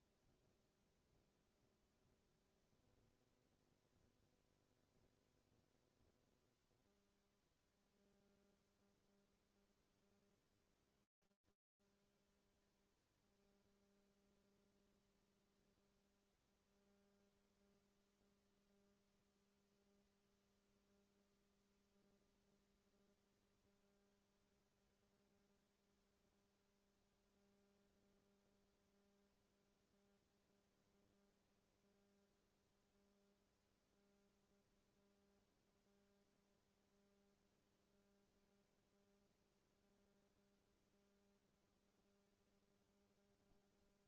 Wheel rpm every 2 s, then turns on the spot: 0, 0, 0, 0, 0, 0, 0, 0, 0, 0, 0, 0, 0, 0, 0, 0, 0, 0, 0, 0, 0, 0.
none